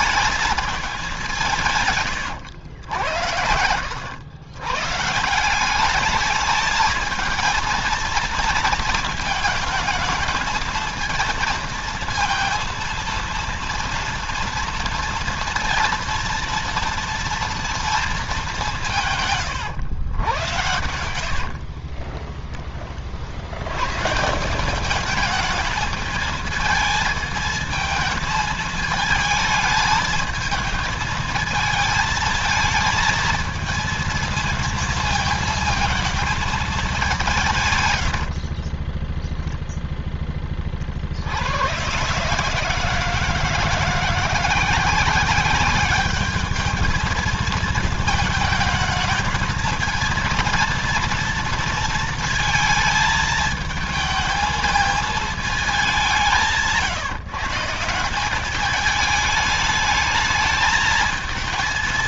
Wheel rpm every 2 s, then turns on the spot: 210, 100, 120, 220, 230, 220, 230, 230, 230, 180, 110, 20, 190, 220, 220, 220, 220, 230, 210, 40, 30, 150, 170, 210, 220, 230, 230, 220, 170, 200, 210.
20-22 38-40